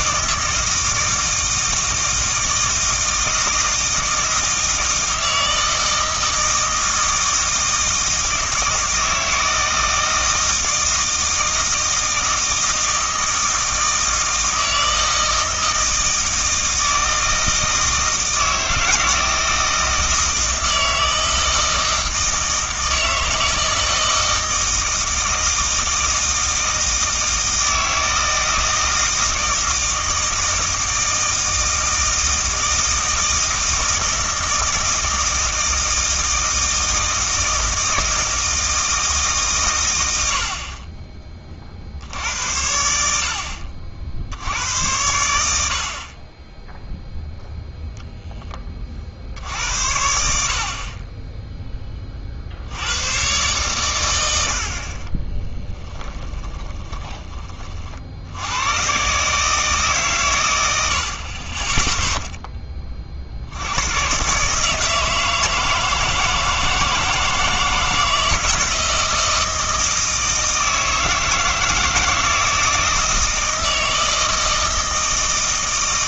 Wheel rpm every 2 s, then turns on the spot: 160, 160, 160, 160, 160, 160, 160, 160, 160, 160, 160, 160, 160, 160, 160, 160, 160, 160, 160, 160, 50, 90, 80, 10, 30, 40, 80, 70, 30, 120, 80, 30, 160, 160, 160, 160, 160, 160.
56-58